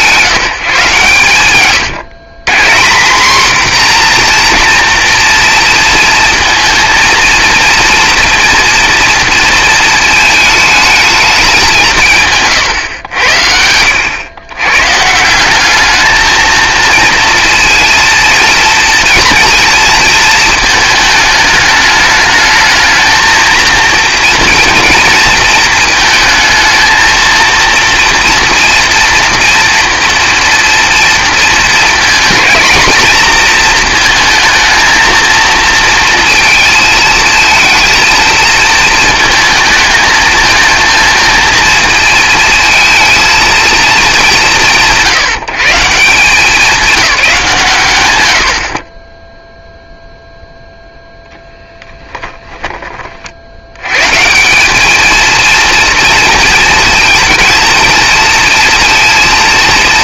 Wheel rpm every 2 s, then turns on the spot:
140, 160, 240, 230, 230, 220, 120, 120, 230, 230, 220, 220, 230, 220, 240, 230, 220, 220, 230, 220, 230, 230, 150, 190, 30, 0, 20, 200, 230, 230.
none